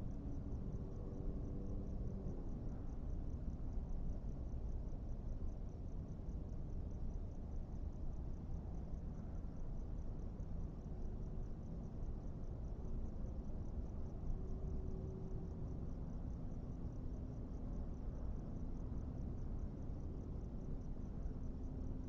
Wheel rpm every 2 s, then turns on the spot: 0, 0, 0, 0, 0, 0, 0, 0, 0, 0, 0.
none